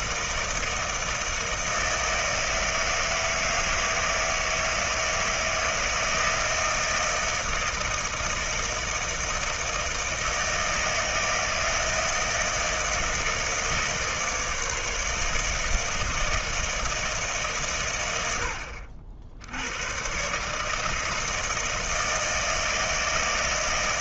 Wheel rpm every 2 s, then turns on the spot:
160, 160, 160, 160, 160, 160, 160, 150, 160, 80, 160, 160.
none